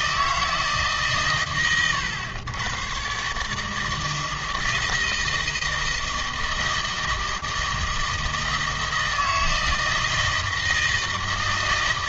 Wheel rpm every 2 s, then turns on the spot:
150, 120, 160, 160, 160, 160.
none